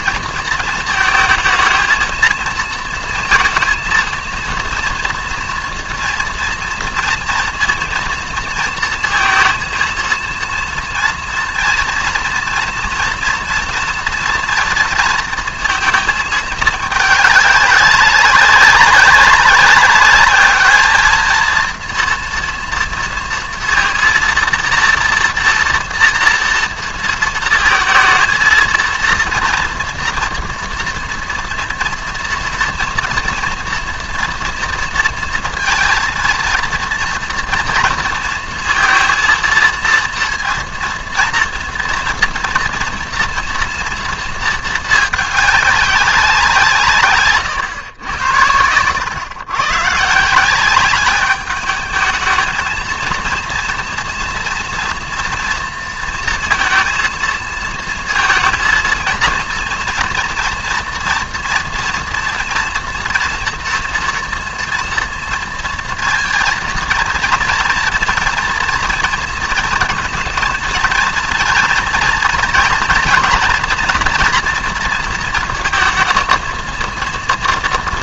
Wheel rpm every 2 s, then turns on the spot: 220, 230, 230, 230, 230, 230, 230, 230, 210, 190, 210, 230, 230, 230, 230, 230, 230, 230, 230, 230, 230, 230, 220, 160, 100, 200, 220, 230, 230, 230, 240, 230, 230, 230, 230, 230, 230, 230, 230.
none